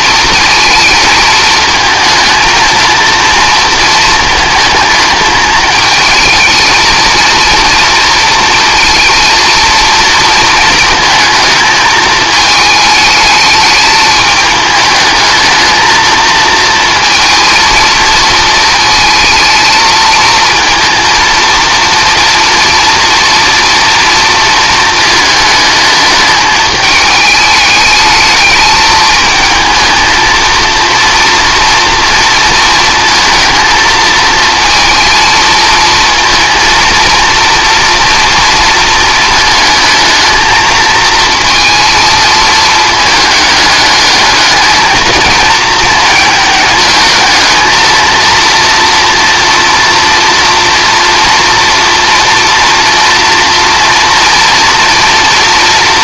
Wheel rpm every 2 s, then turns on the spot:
220, 220, 220, 230, 230, 230, 220, 210, 230, 220, 230, 230, 230, 210, 210, 230, 230, 230, 230, 230, 220, 220, 220, 220, 230, 230, 230, 230.
none